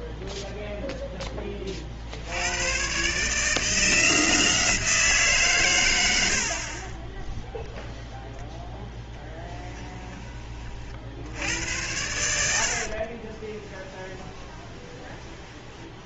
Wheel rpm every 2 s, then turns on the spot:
0, 100, 170, 60, 0, 30, 70, 20.
12-16